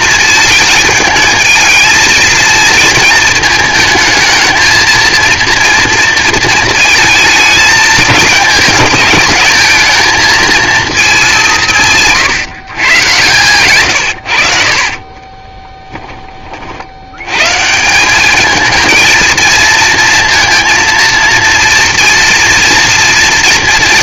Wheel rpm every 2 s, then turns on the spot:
220, 220, 220, 220, 210, 220, 140, 60, 50, 220, 230, 230.
14-16